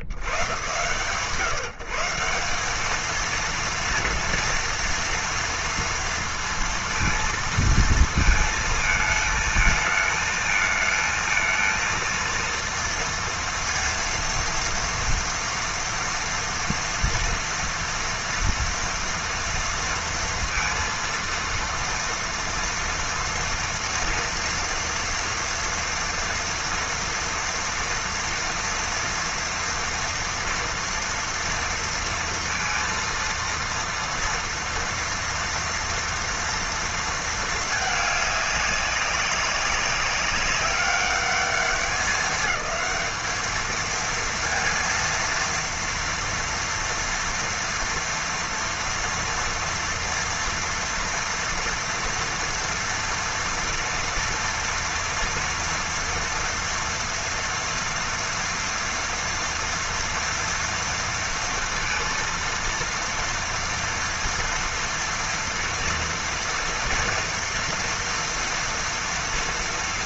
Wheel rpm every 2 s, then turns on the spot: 70, 180, 230, 230, 220, 220, 230, 230, 230, 230, 230, 230, 230, 230, 230, 240, 230, 230, 230, 200, 200, 210, 230, 230, 230, 230, 230, 230, 230, 240, 230, 230, 230, 230, 230.
none